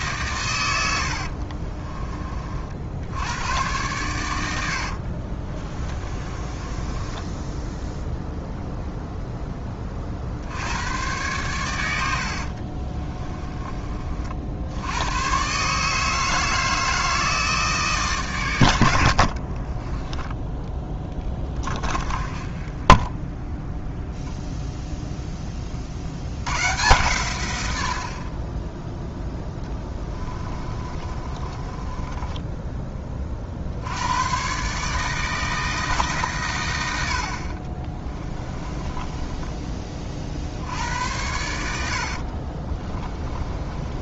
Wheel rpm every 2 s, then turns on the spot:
100, 50, 70, 20, 0, 100, 40, 70, 160, 80, 10, 20, 0, 110, 20, 30, 20, 140, 90, 20, 70, 30.
6-8 12-14 22-24 30-32 38-40 42-44